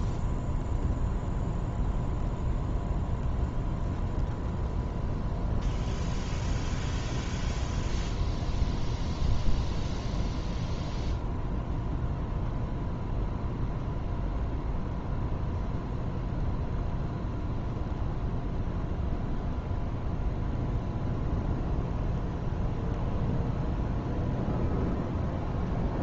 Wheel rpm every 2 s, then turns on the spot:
0, 0, 0, 0, 0, 0, 0, 0, 0, 0, 0, 0, 0.
none